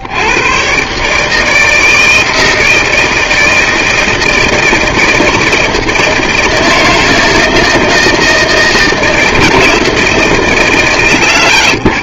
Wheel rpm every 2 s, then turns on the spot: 80, 160, 160, 160, 160, 160.
none